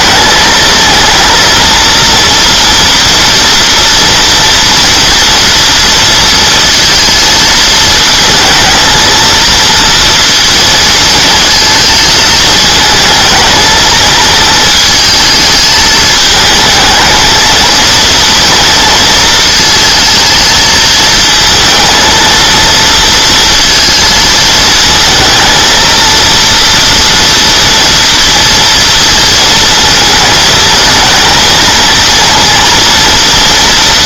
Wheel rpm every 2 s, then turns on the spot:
220, 240, 230, 230, 220, 220, 220, 220, 230, 230, 230, 230, 230, 230, 230, 220, 230.
none